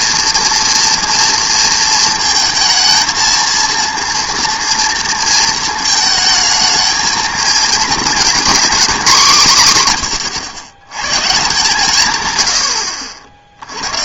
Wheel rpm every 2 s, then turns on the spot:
230, 230, 230, 220, 240, 110, 100.
none